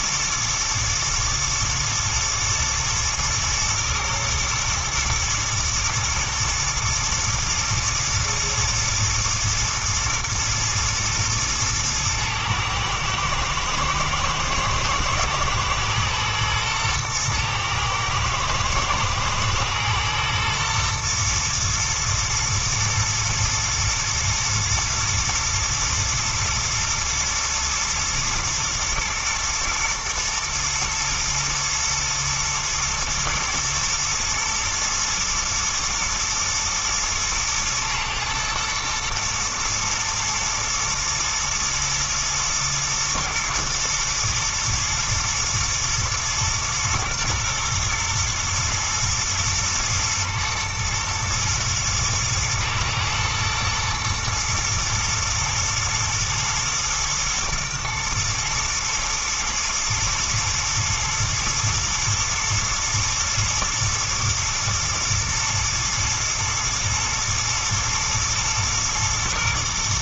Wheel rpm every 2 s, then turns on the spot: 110, 110, 110, 110, 120, 120, 110, 110, 110, 120, 120, 120, 110, 120, 110, 120, 110, 110, 120, 110, 110, 110, 110, 120, 120, 120, 110, 120, 120, 120, 120, 120, 110, 110, 120.
none